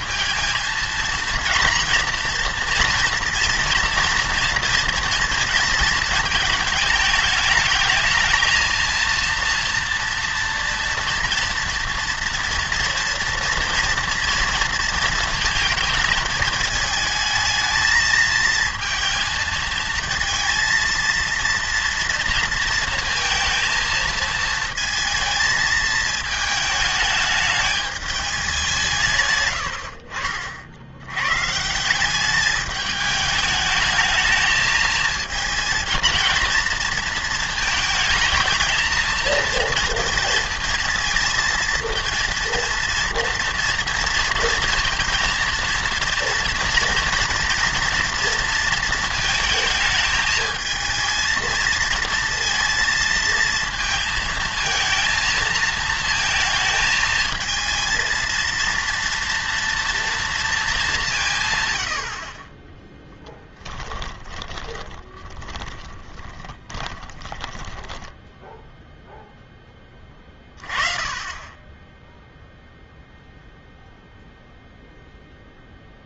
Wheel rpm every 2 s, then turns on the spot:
220, 240, 230, 220, 230, 230, 240, 230, 220, 220, 230, 230, 220, 220, 180, 60, 210, 220, 230, 230, 230, 230, 230, 230, 230, 220, 230, 230, 230, 230, 220, 30, 20, 20, 0, 30, 0, 0.
64-68